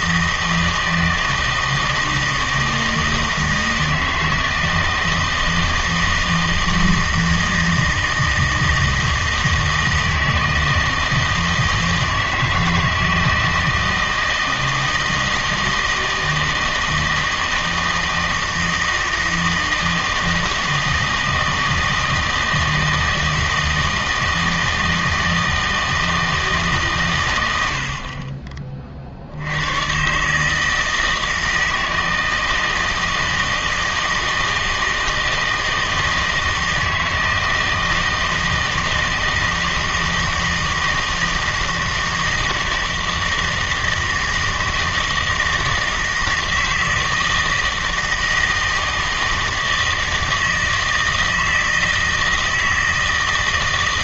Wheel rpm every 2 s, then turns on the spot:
160, 160, 160, 160, 160, 160, 160, 160, 160, 160, 160, 160, 160, 140, 30, 160, 160, 160, 160, 160, 160, 160, 160, 160, 160, 160, 160.
none